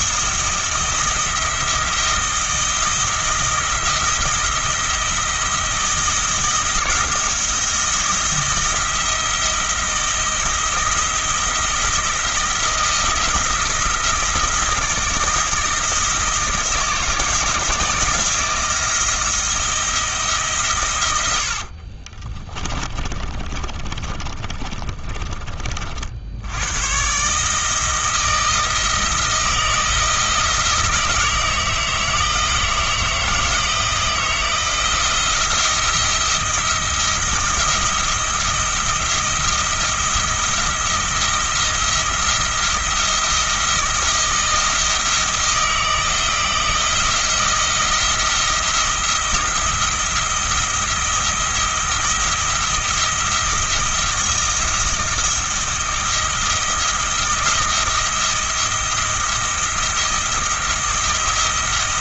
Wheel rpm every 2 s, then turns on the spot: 170, 170, 170, 170, 170, 170, 170, 160, 160, 170, 130, 30, 40, 110, 160, 160, 160, 170, 170, 170, 170, 170, 170, 170, 170, 170, 170, 170, 170, 170, 170.
22-26